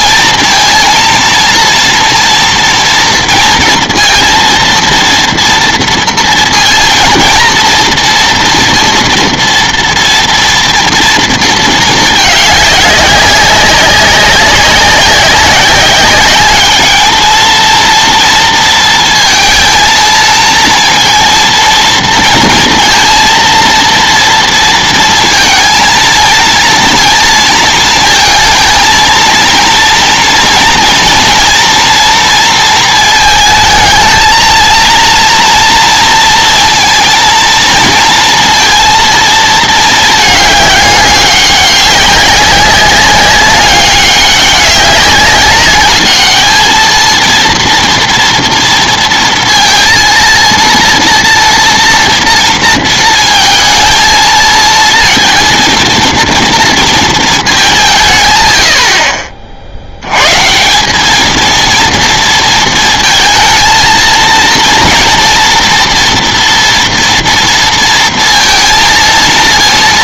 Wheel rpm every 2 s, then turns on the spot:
230, 230, 230, 230, 230, 230, 200, 190, 210, 230, 230, 230, 230, 230, 220, 230, 220, 230, 230, 230, 200, 200, 200, 220, 230, 230, 230, 230, 230, 70, 180, 230, 230, 230, 230.
none